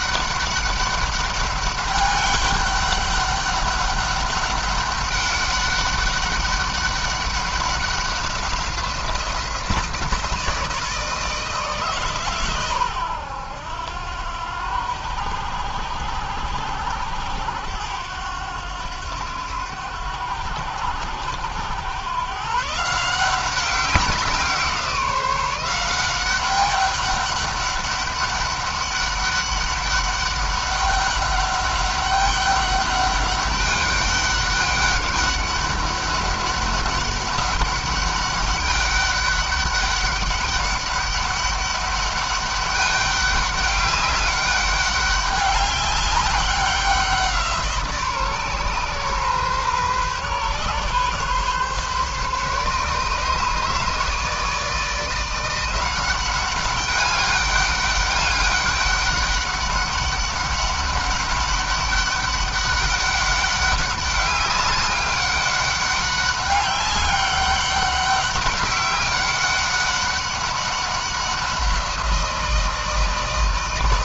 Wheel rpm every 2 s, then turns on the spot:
200, 200, 200, 200, 180, 160, 110, 90, 90, 90, 90, 160, 180, 200, 200, 200, 200, 200, 200, 200, 200, 200, 200, 190, 130, 140, 150, 160, 200, 200, 190, 200, 190, 200, 200, 190, 160.
none